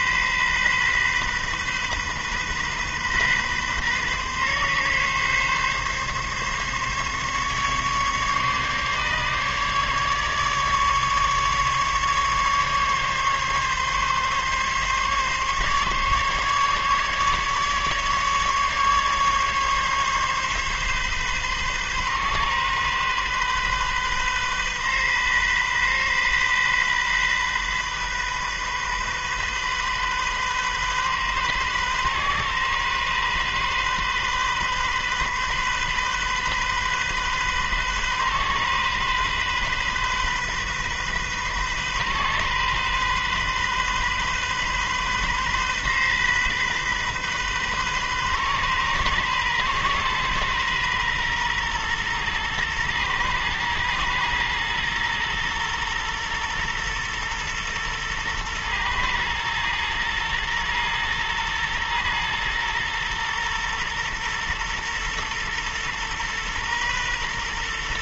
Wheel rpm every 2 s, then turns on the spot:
130, 130, 140, 140, 140, 150, 140, 140, 140, 140, 140, 130, 130, 130, 130, 130, 130, 130, 130, 130, 130, 130, 130, 130, 130, 130, 120, 120, 120, 120, 120, 120, 120, 120.
none